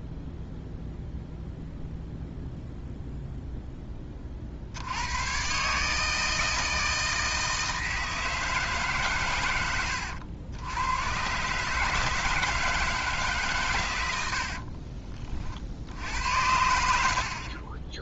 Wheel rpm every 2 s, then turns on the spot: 0, 0, 50, 160, 150, 90, 170, 60, 80.
14-16